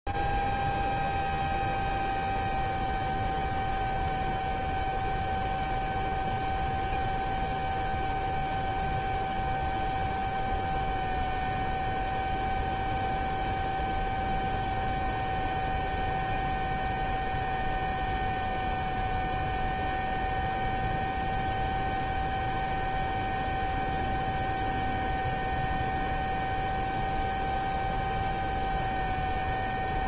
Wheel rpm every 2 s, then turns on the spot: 0, 0, 0, 0, 0, 0, 0, 0, 0, 0, 0, 0, 0, 0, 0.
none